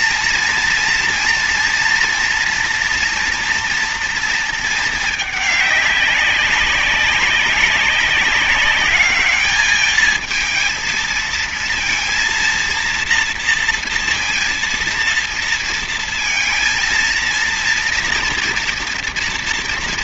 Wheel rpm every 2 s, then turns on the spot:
230, 230, 230, 190, 200, 220, 230, 230, 230, 230.
none